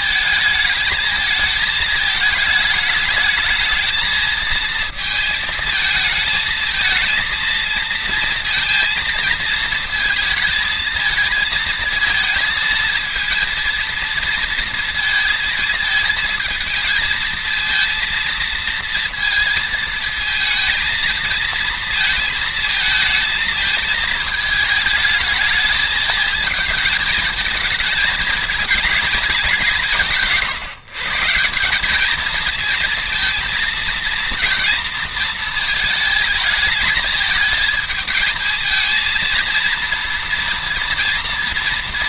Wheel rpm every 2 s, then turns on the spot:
220, 210, 220, 220, 230, 220, 220, 230, 220, 230, 220, 220, 210, 220, 220, 160, 230, 230, 220, 220, 230.
none